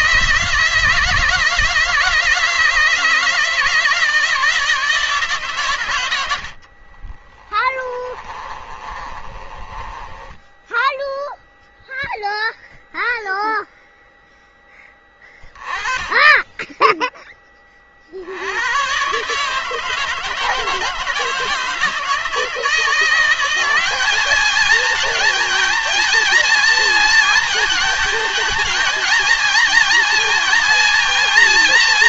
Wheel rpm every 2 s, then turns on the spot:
160, 160, 160, 80, 20, 10, 0, 10, 20, 80, 160, 160, 210, 230, 230, 230.
6-12